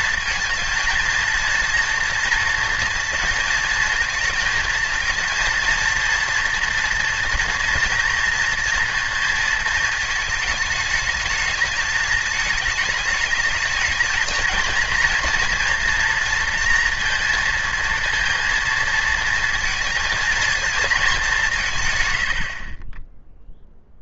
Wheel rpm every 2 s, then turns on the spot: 230, 230, 230, 230, 230, 220, 220, 220, 230, 230, 210, 20.
none